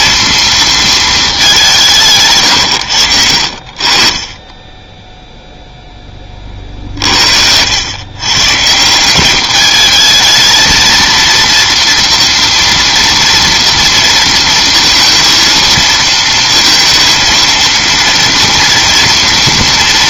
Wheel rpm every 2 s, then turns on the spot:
230, 100, 10, 40, 160, 220, 230, 230, 230, 230.
none